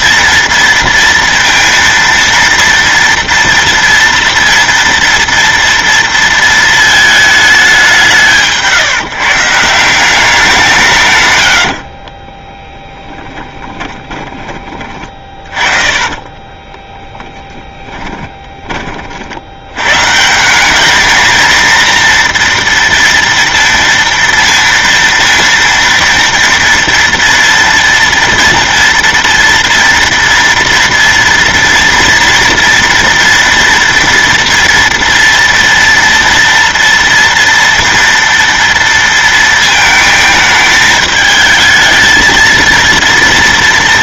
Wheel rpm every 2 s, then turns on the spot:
230, 230, 230, 230, 160, 180, 20, 20, 20, 20, 180, 230, 230, 230, 230, 230, 230, 240, 230, 230, 220, 230.
12-18